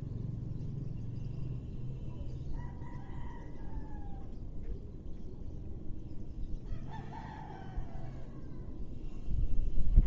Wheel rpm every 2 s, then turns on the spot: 0, 0, 0, 0, 0.
none